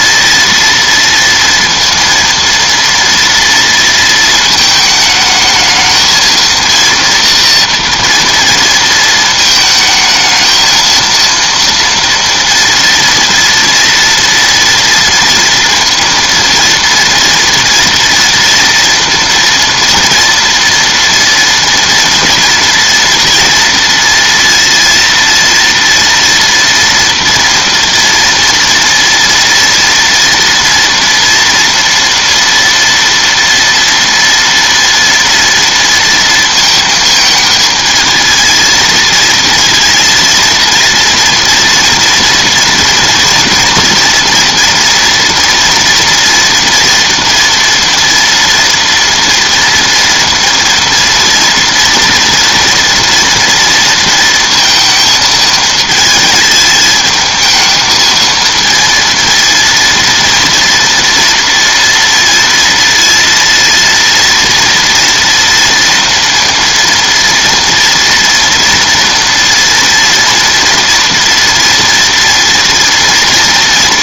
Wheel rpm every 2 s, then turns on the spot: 230, 230, 220, 230, 230, 230, 230, 230, 230, 230, 230, 230, 230, 230, 230, 230, 240, 230, 220, 230, 230, 240, 230, 230, 230, 230, 230, 230, 220, 230, 230, 230, 230, 230, 230, 230, 230.
none